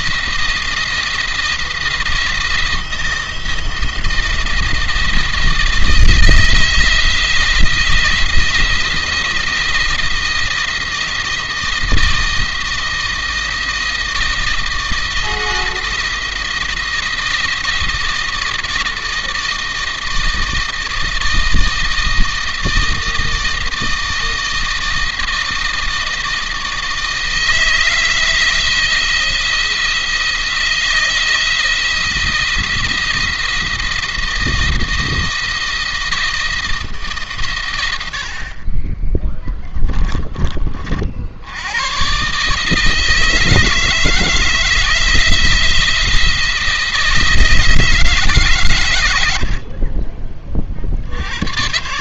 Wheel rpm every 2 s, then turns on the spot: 170, 170, 160, 160, 170, 170, 160, 160, 170, 160, 160, 160, 160, 160, 160, 170, 170, 170, 150, 20, 40, 150, 160, 160, 120, 70.
38-40